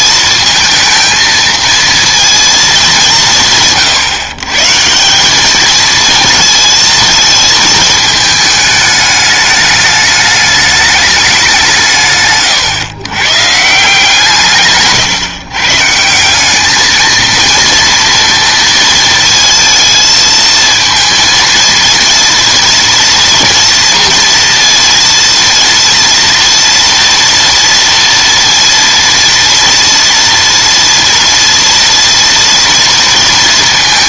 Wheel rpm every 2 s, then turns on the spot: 220, 220, 150, 220, 220, 210, 130, 150, 200, 230, 230, 230, 230, 230, 230, 240, 230.
none